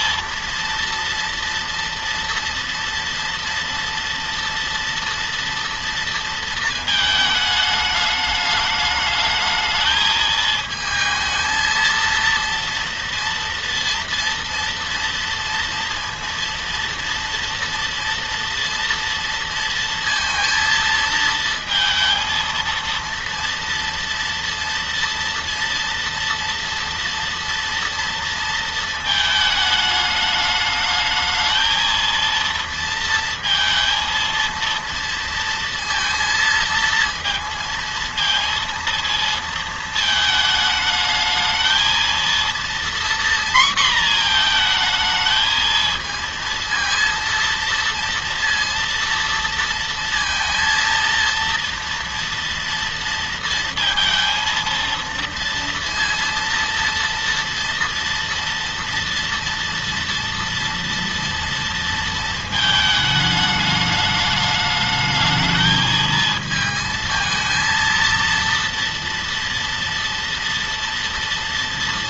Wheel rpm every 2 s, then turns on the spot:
230, 230, 240, 220, 210, 220, 230, 230, 230, 230, 230, 230, 230, 230, 220, 220, 230, 230, 230, 230, 220, 240, 230, 230, 230, 230, 230, 230, 230, 230, 230, 220, 220, 220, 230, 230.
none